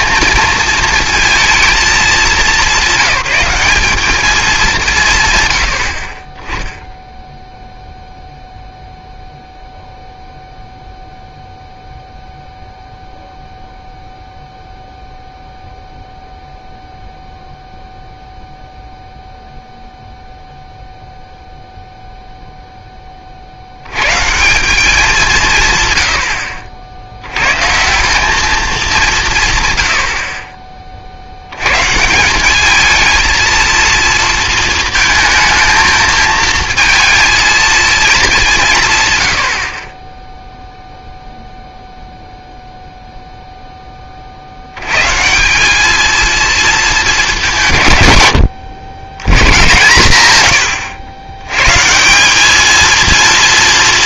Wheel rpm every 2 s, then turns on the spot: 230, 200, 190, 20, 0, 0, 0, 0, 0, 0, 0, 0, 180, 50, 200, 30, 200, 230, 220, 180, 0, 0, 70, 220, 110, 110, 210.
50-52